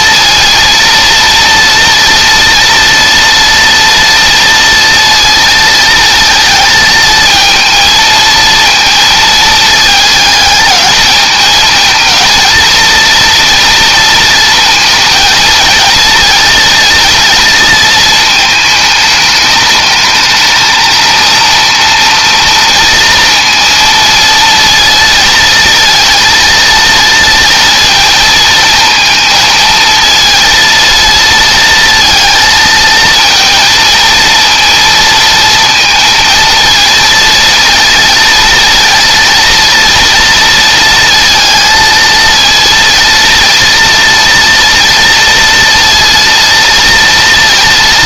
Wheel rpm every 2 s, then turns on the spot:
230, 230, 230, 220, 230, 210, 230, 220, 230, 210, 230, 230, 230, 230, 230, 230, 220, 230, 230, 230, 230, 230, 230, 230.
none